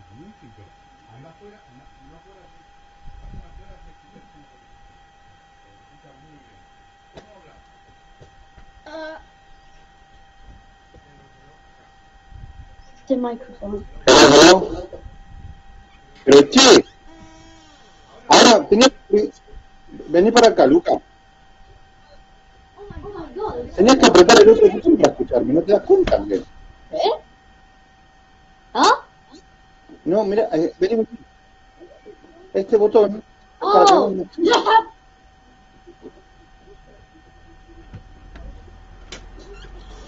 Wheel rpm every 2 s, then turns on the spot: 0, 0, 0, 0, 0, 0, 0, 0, 0, 0, 0, 0, 0, 0, 0, 0, 0, 0, 0, 0.
none